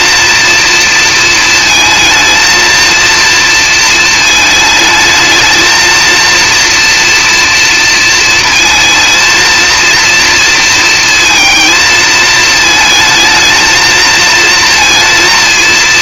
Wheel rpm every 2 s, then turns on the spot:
230, 220, 220, 240, 220, 230, 220, 230.
none